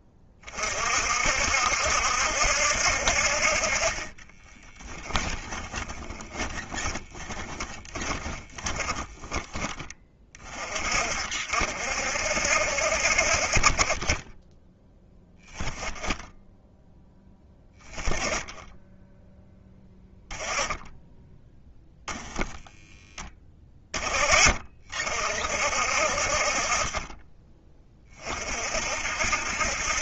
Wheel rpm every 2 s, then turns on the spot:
30, 70, 20, 20, 20, 40, 60, 10, 0, 10, 10, 10, 40, 40, 40.
4-10